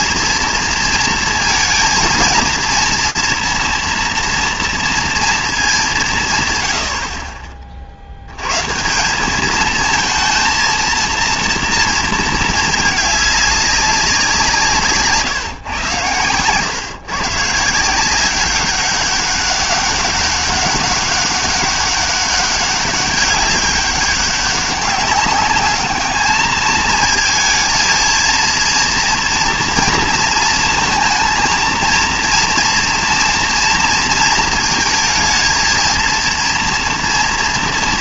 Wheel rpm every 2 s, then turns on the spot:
230, 230, 230, 100, 140, 230, 220, 160, 120, 190, 190, 200, 200, 220, 230, 230, 230, 230, 230.
none